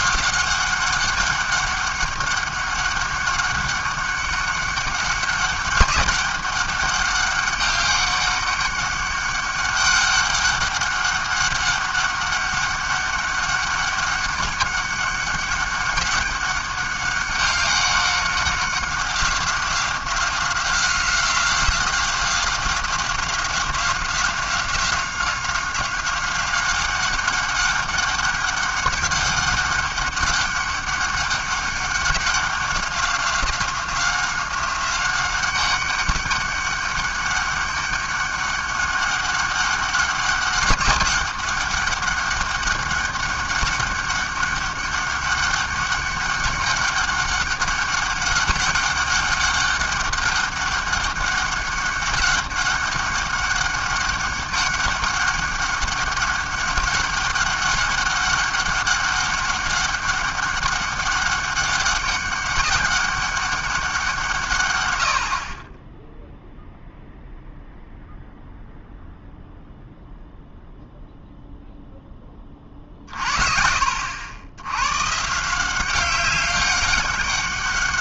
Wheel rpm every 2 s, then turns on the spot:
190, 200, 190, 190, 200, 200, 200, 200, 200, 190, 180, 190, 190, 190, 200, 200, 190, 190, 200, 200, 200, 200, 200, 200, 190, 200, 200, 200, 200, 200, 200, 200, 120, 0, 0, 0, 30, 100, 200.
none